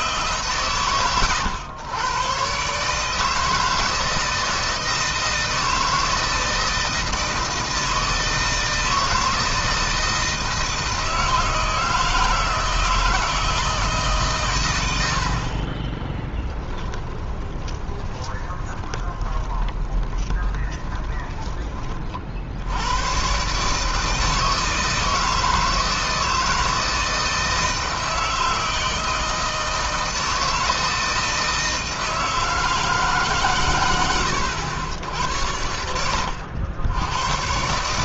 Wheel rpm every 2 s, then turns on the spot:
120, 150, 160, 160, 160, 160, 160, 100, 10, 20, 20, 100, 160, 160, 160, 160, 150, 90, 100.
16-22